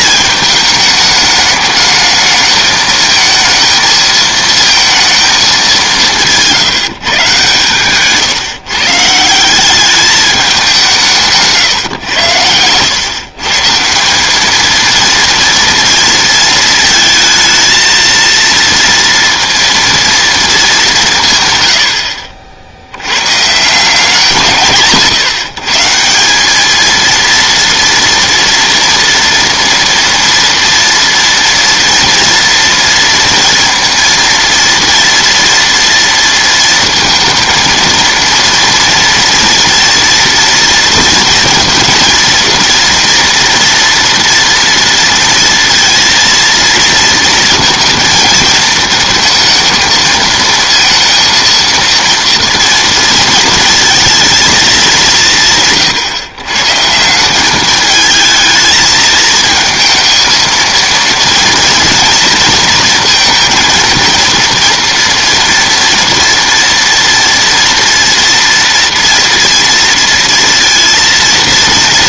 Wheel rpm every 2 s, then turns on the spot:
210, 220, 220, 160, 140, 190, 110, 220, 230, 230, 220, 70, 140, 210, 230, 240, 230, 230, 230, 230, 230, 230, 230, 230, 230, 230, 230, 220, 140, 220, 220, 230, 230, 230, 230, 230.
none